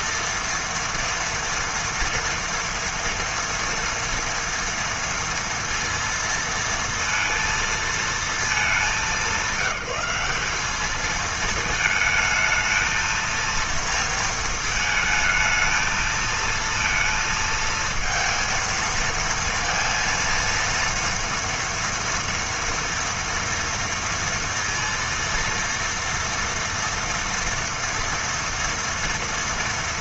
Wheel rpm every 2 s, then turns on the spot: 230, 230, 230, 230, 210, 200, 220, 220, 230, 230, 230, 230, 230, 240, 230.
none